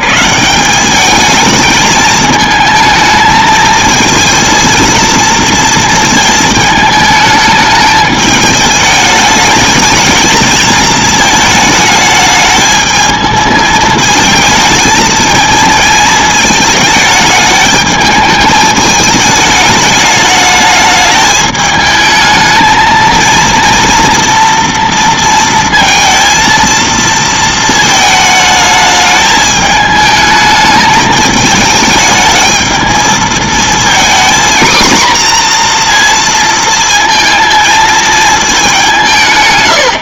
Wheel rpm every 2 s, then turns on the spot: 140, 220, 230, 220, 210, 220, 220, 220, 220, 220, 210, 220, 230, 230, 220, 210, 220, 240, 230, 180.
none